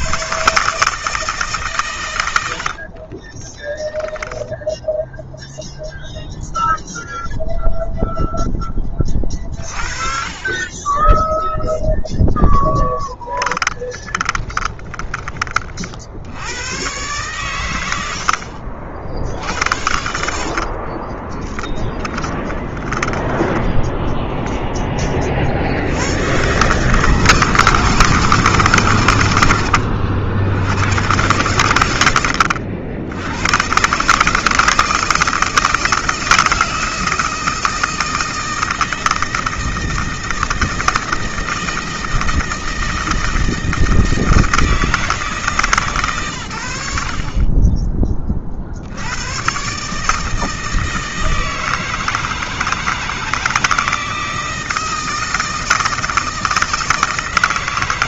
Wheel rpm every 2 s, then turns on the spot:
150, 50, 0, 0, 30, 20, 10, 20, 110, 70, 30, 10, 20, 160, 120, 110, 80, 160, 160, 160, 160, 160, 160, 70, 80, 160, 160, 160, 160.
2-4 12-14 20-22